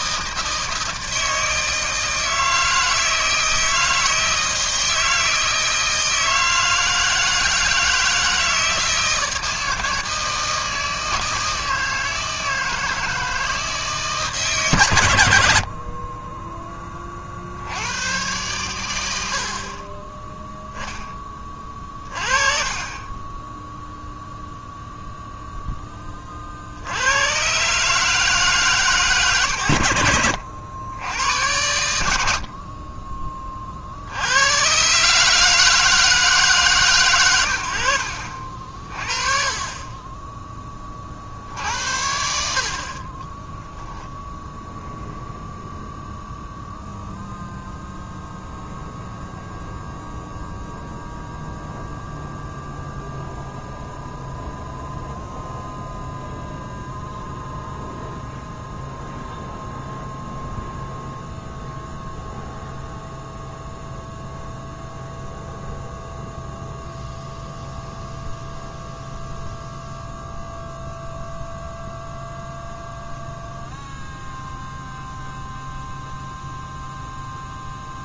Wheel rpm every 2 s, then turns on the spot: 160, 160, 160, 160, 160, 160, 160, 130, 10, 110, 0, 30, 0, 70, 140, 90, 30, 130, 140, 40, 20, 50, 0, 0, 0, 0, 0, 0, 0, 0, 0, 0, 0, 0, 0, 0, 0, 0, 0.
none